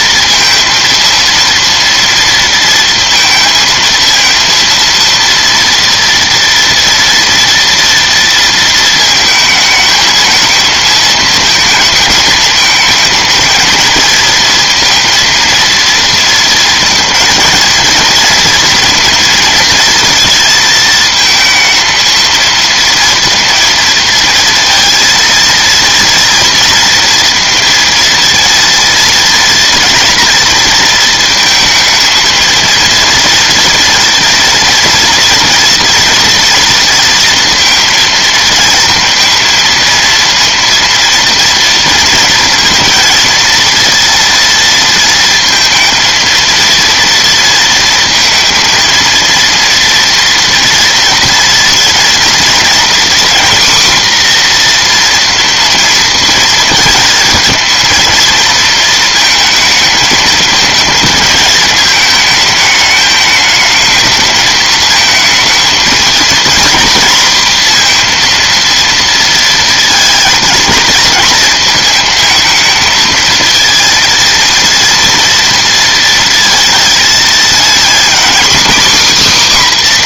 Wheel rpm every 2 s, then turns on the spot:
230, 230, 230, 230, 230, 230, 220, 230, 230, 230, 230, 230, 230, 230, 230, 230, 230, 230, 230, 230, 230, 230, 230, 230, 230, 230, 230, 250, 230, 230, 220, 210, 220, 230, 230, 220, 220, 230, 230, 260.
none